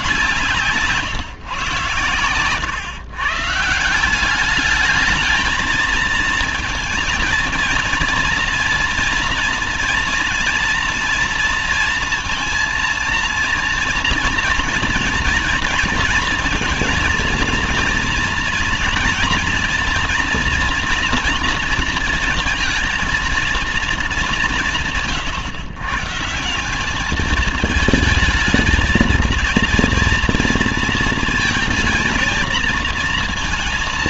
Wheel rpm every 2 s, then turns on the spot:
150, 120, 200, 230, 230, 240, 230, 230, 230, 240, 240, 230, 170, 180, 220, 230, 230.
none